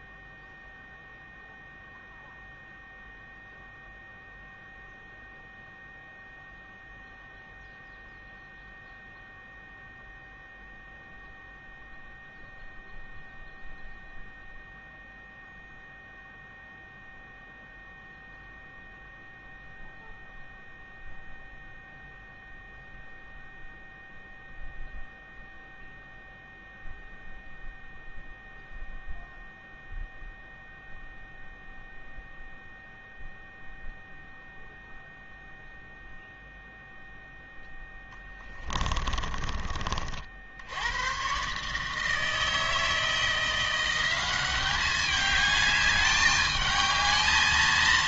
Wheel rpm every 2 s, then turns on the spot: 0, 0, 0, 0, 0, 0, 0, 0, 0, 0, 0, 0, 0, 0, 0, 0, 0, 0, 0, 20, 70, 160, 190, 210.
38-40